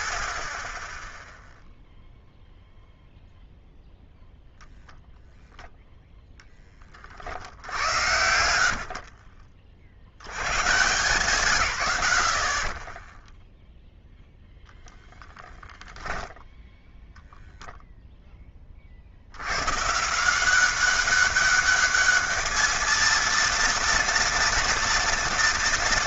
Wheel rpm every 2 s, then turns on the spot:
0, 0, 0, 70, 30, 110, 0, 10, 0, 100, 200, 230, 230.
8-10